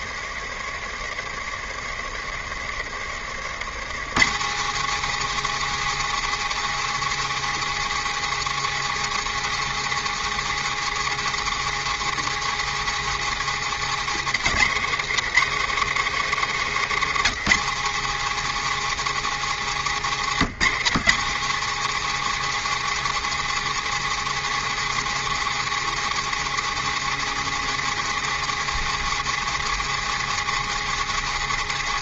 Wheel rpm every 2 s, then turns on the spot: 140, 140, 260, 290, 290, 290, 290, 280, 280, 290, 250, 290, 290, 290, 290, 290.
none